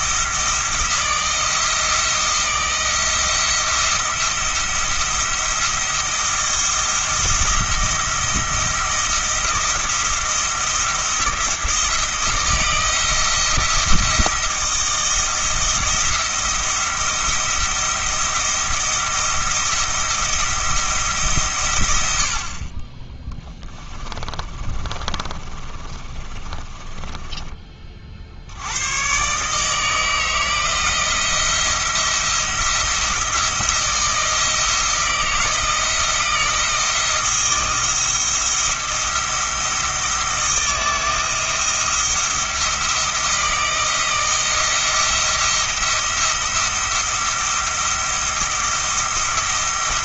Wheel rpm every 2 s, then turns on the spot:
160, 170, 170, 170, 170, 170, 160, 170, 170, 170, 170, 30, 30, 20, 100, 160, 170, 160, 160, 170, 170, 170, 170, 170, 170.
24-28